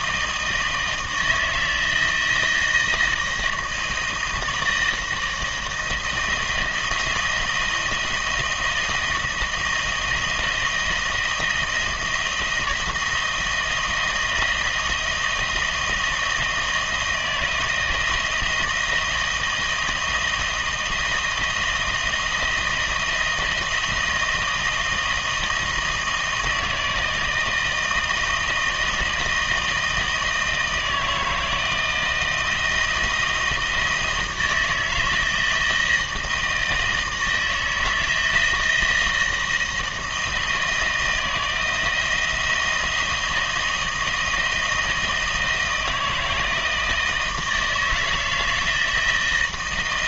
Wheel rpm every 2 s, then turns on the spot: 160, 160, 160, 170, 160, 170, 160, 160, 160, 160, 160, 160, 160, 160, 160, 160, 170, 160, 160, 170, 170, 170, 160, 160, 160.
none